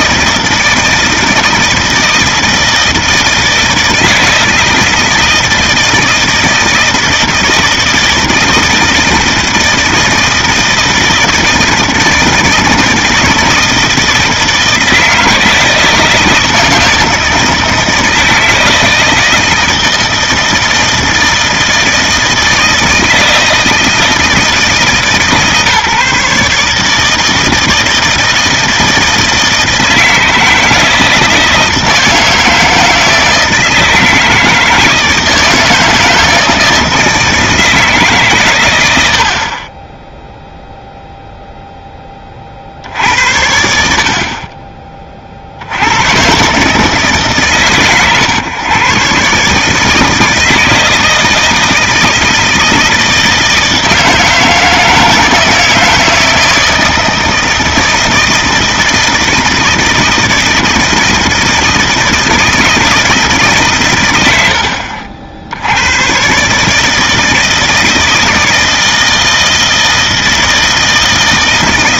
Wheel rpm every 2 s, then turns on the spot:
160, 160, 160, 160, 160, 160, 160, 160, 160, 160, 160, 160, 160, 150, 160, 160, 160, 160, 160, 110, 0, 60, 20, 130, 130, 160, 160, 160, 160, 160, 160, 160, 60, 150, 160, 160.
none